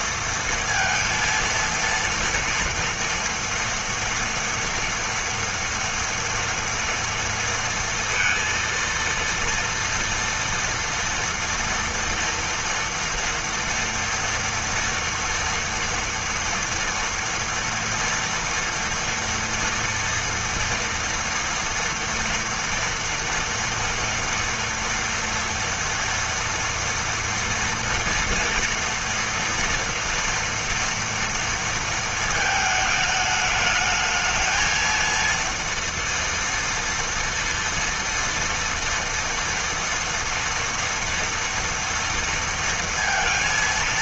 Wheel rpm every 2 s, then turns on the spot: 230, 230, 230, 240, 230, 230, 230, 230, 230, 230, 230, 230, 230, 230, 230, 230, 220, 220, 230, 230, 230, 230.
none